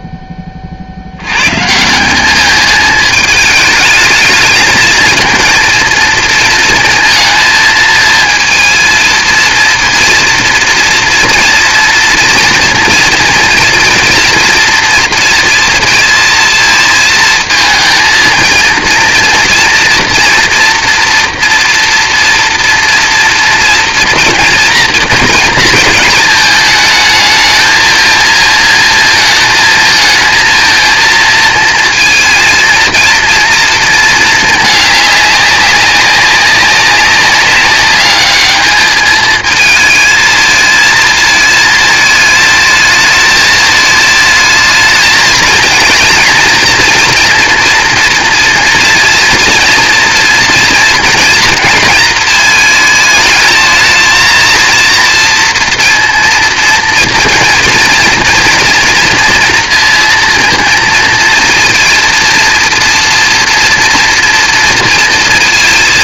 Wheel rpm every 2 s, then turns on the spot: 50, 210, 220, 230, 220, 230, 240, 230, 230, 230, 230, 230, 230, 220, 220, 230, 230, 220, 200, 210, 220, 220, 220, 230, 240, 230, 220, 230, 230, 230, 230, 230, 230.
none